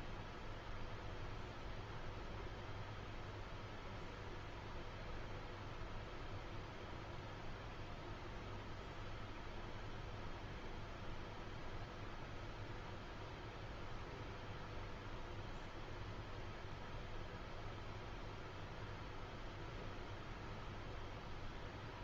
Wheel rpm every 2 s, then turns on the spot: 0, 0, 0, 0, 0, 0, 0, 0, 0, 0, 0.
none